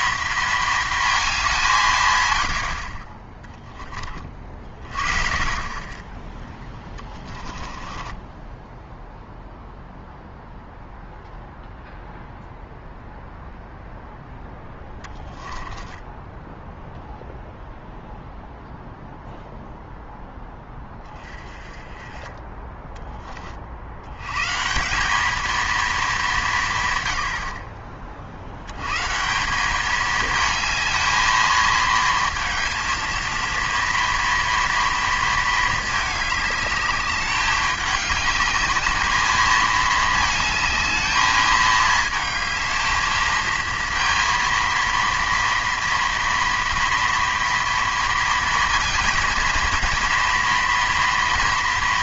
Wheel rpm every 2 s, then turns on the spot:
220, 50, 40, 10, 0, 0, 0, 20, 0, 0, 10, 10, 170, 160, 110, 220, 230, 230, 210, 210, 220, 220, 230, 230, 230, 230.
6-8 14-16